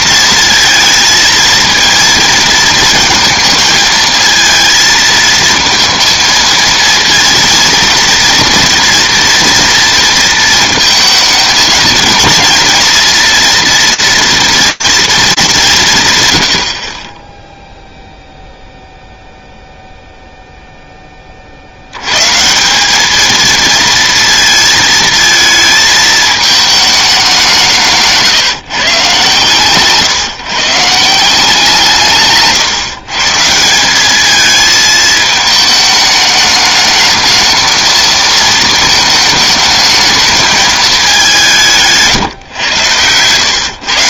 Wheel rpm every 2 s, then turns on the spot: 230, 220, 220, 220, 230, 230, 230, 230, 90, 0, 0, 160, 230, 220, 150, 150, 140, 220, 210, 230, 220, 120.
none